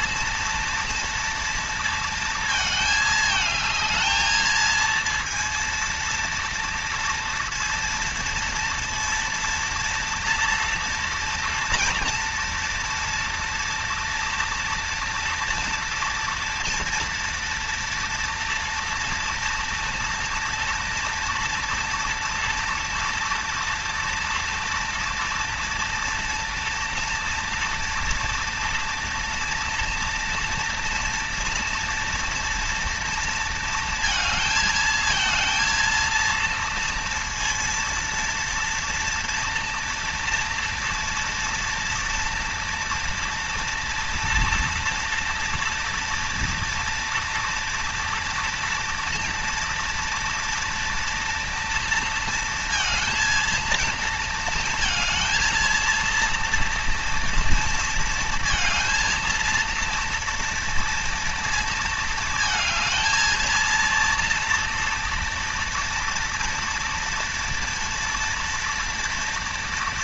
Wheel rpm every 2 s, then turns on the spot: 230, 220, 220, 230, 230, 230, 230, 230, 240, 230, 230, 230, 230, 230, 240, 230, 230, 220, 230, 230, 230, 230, 230, 240, 230, 230, 230, 220, 230, 230, 230, 230, 230, 230, 230.
none